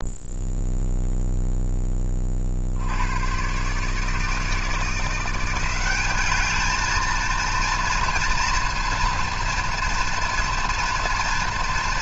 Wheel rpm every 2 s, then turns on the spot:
0, 100, 170, 230, 230, 240.
none